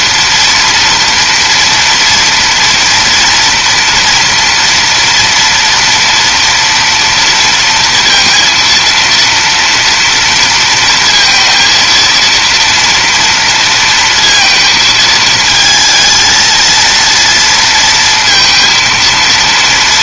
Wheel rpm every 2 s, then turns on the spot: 230, 230, 230, 230, 230, 230, 230, 220, 230, 230.
none